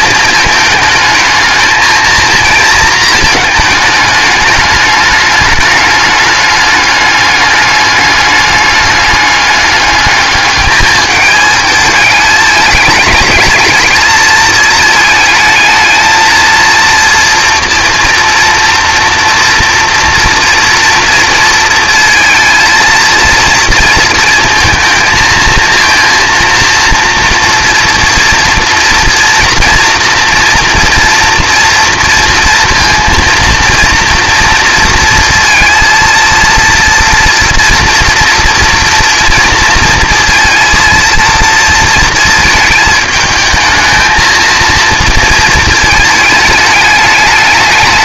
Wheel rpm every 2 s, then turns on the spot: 220, 230, 200, 200, 200, 210, 220, 220, 230, 230, 230, 230, 220, 230, 230, 230, 230, 230, 230, 230, 230, 220, 220, 210.
none